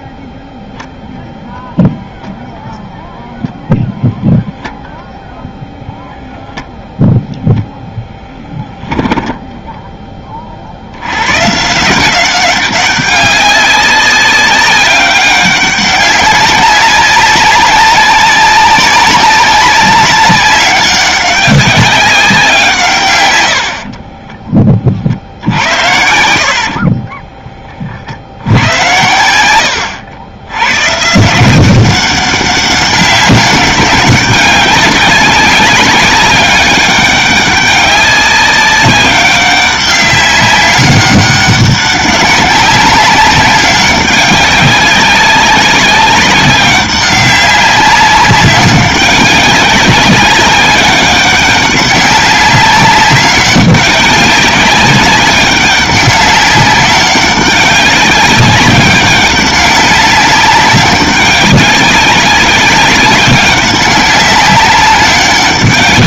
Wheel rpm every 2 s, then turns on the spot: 0, 0, 0, 0, 10, 70, 200, 200, 200, 190, 200, 160, 30, 50, 90, 110, 200, 200, 200, 190, 200, 200, 200, 200, 200, 200, 190, 200, 200, 200, 200, 190, 190.
26-28